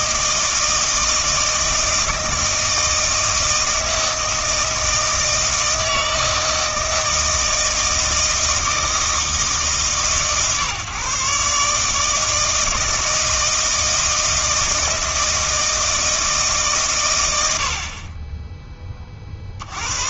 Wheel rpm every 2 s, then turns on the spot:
160, 160, 160, 160, 160, 140, 160, 160, 140, 20.
none